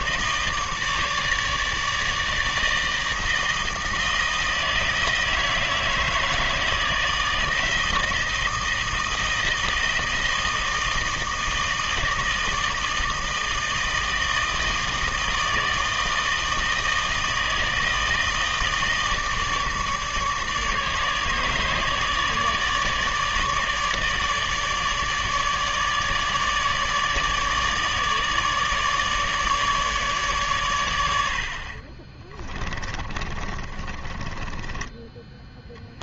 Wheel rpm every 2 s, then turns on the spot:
150, 160, 160, 160, 160, 160, 160, 160, 160, 160, 150, 150, 150, 150, 150, 110, 20, 10.
32-36